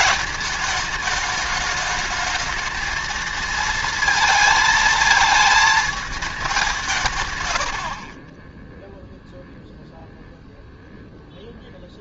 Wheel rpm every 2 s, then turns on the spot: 210, 220, 220, 190, 20, 0.
none